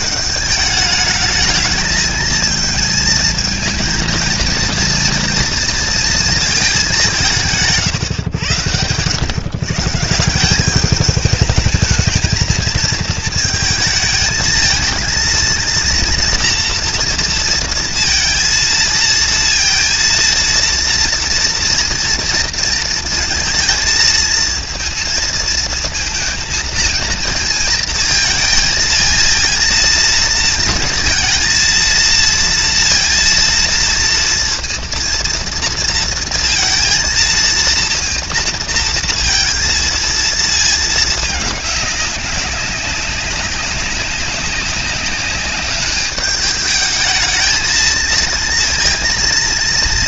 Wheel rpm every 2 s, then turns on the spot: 210, 220, 230, 220, 100, 180, 220, 220, 230, 230, 230, 230, 220, 220, 230, 230, 230, 230, 230, 230, 220, 200, 190, 210, 230.
none